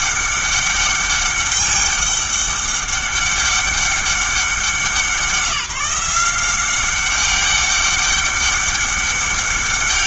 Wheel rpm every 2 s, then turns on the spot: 200, 200, 190, 190, 190.
none